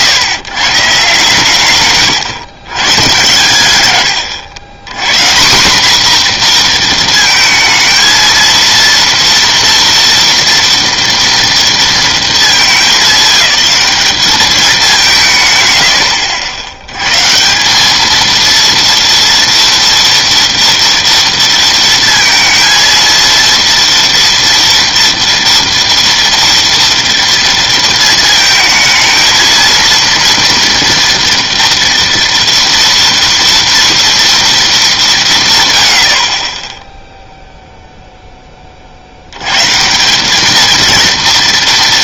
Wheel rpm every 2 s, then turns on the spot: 140, 130, 110, 240, 230, 230, 220, 210, 80, 230, 230, 230, 240, 230, 220, 230, 230, 240, 40, 20, 210.
none